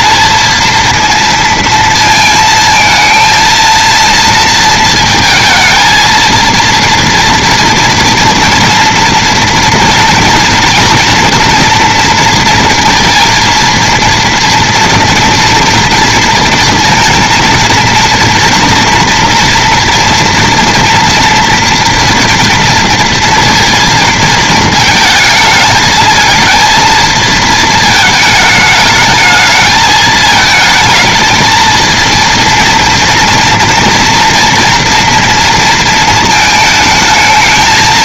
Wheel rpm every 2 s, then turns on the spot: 230, 230, 230, 230, 230, 230, 230, 230, 230, 240, 230, 230, 220, 230, 220, 220, 230, 240, 220.
none